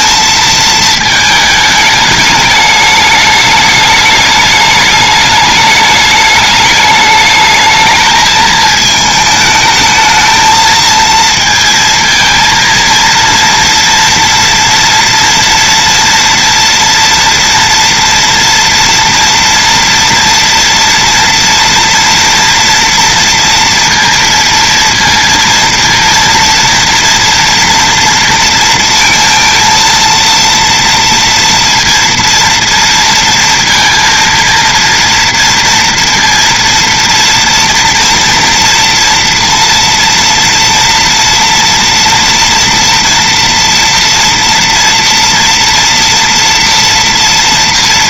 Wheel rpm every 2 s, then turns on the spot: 220, 210, 210, 210, 220, 220, 230, 230, 230, 230, 230, 240, 230, 230, 230, 230, 230, 230, 230, 230, 230, 230, 240, 230.
none